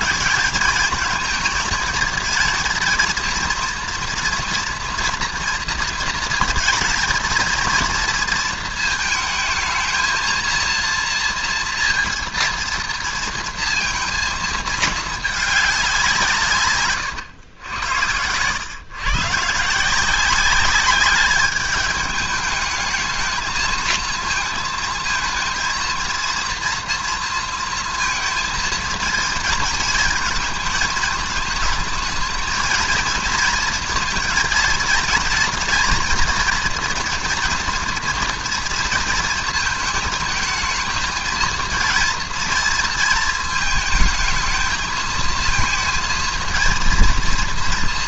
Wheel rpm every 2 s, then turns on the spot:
190, 230, 230, 220, 230, 230, 230, 220, 140, 120, 190, 210, 220, 230, 230, 230, 230, 230, 230, 230, 220, 230, 220, 230.
none